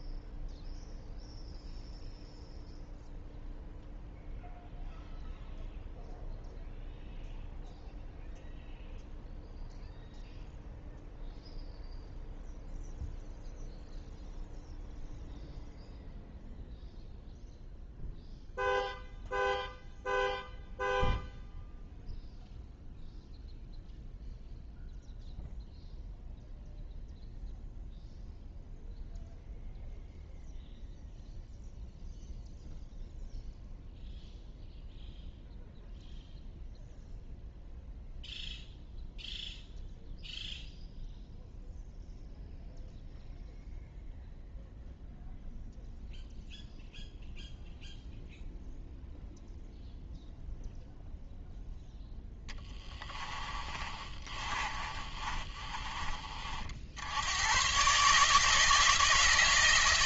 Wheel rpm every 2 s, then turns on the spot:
0, 0, 0, 0, 0, 0, 0, 0, 0, 0, 0, 0, 0, 0, 0, 0, 0, 0, 0, 0, 0, 0, 0, 0, 0, 0, 10, 30, 70, 160.
52-56